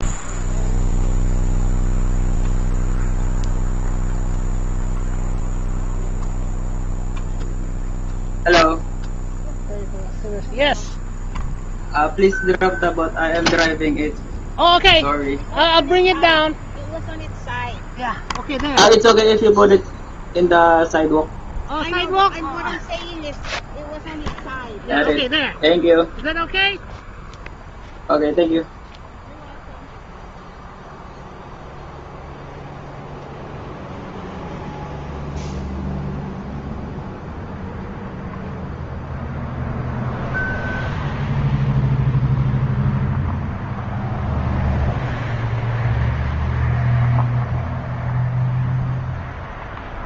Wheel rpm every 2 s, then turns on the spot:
0, 0, 0, 0, 0, 0, 0, 0, 0, 0, 0, 0, 0, 0, 0, 0, 0, 0, 0, 0, 0, 0, 0, 0, 0.
none